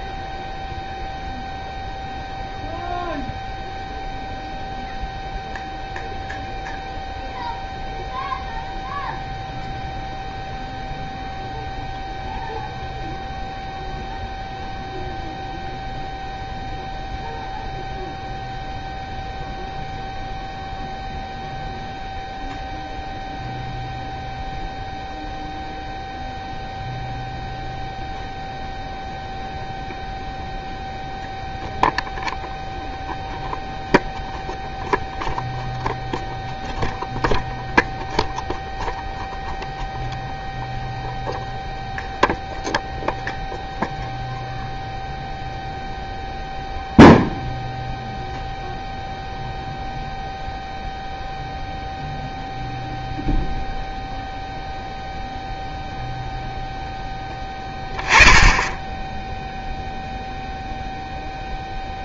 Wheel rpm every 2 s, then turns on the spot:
0, 0, 0, 0, 0, 0, 0, 0, 0, 0, 0, 0, 0, 0, 0, 0, 0, 0, 0, 0, 0, 0, 0, 0, 0, 0, 0, 0, 0, 10, 0.
none